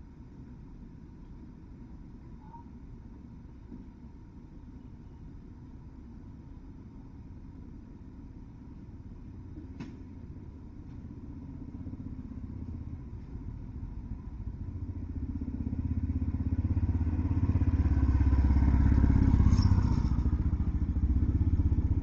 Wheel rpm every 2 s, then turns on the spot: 0, 0, 0, 0, 0, 0, 0, 0, 0, 0, 0.
none